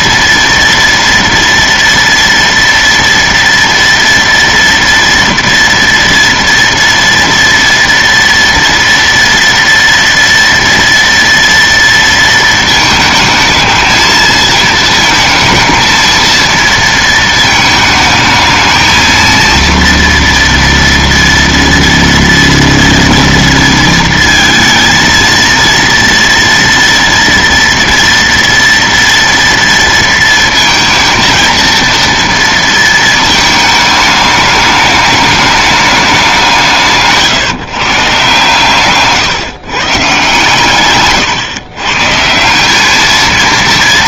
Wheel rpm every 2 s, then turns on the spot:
230, 230, 230, 230, 230, 230, 220, 220, 230, 220, 230, 230, 230, 230, 230, 230, 230, 210, 170, 140, 140, 170.
none